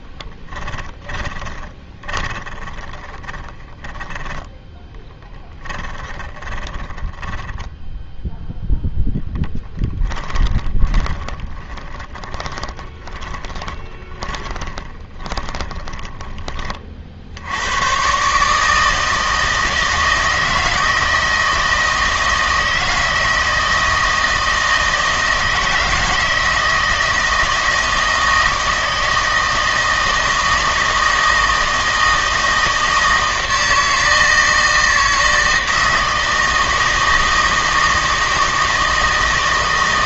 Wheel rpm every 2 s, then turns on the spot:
20, 20, 10, 10, 10, 20, 20, 30, 30, 150, 160, 160, 160, 160, 160, 160, 160, 160, 160, 160.
0-4 10-16